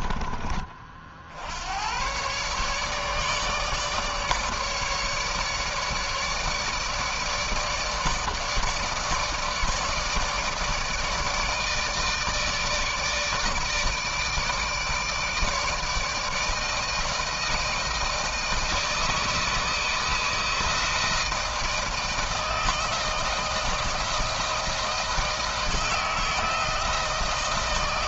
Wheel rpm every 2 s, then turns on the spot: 50, 150, 150, 150, 160, 150, 160, 160, 160, 160, 160, 160, 160, 160.
none